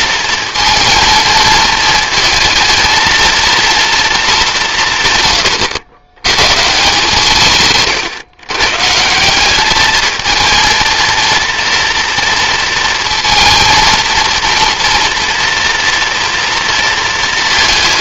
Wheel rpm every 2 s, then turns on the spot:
230, 230, 130, 160, 180, 230, 230, 230, 230.
none